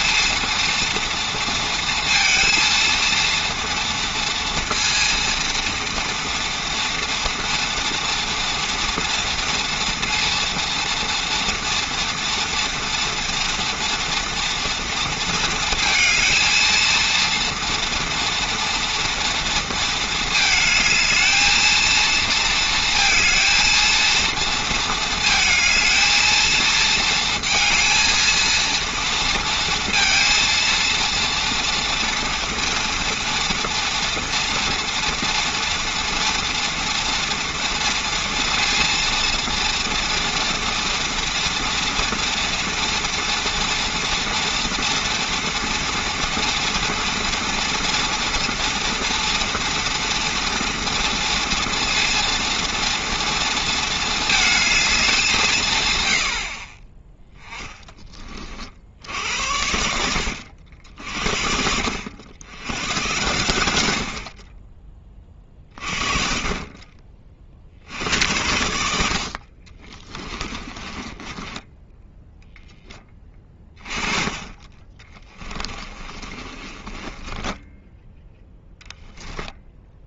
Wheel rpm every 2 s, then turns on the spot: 230, 230, 230, 230, 230, 230, 230, 230, 220, 230, 220, 230, 230, 230, 230, 230, 230, 230, 230, 230, 240, 230, 230, 230, 230, 230, 230, 220, 60, 30, 80, 90, 30, 30, 90, 20, 10, 30, 30, 10.
70-72 76-78